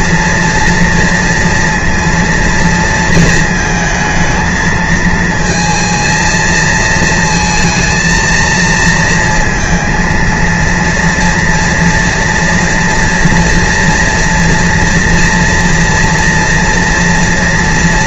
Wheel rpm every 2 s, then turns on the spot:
230, 230, 220, 230, 230, 230, 230, 230, 230.
none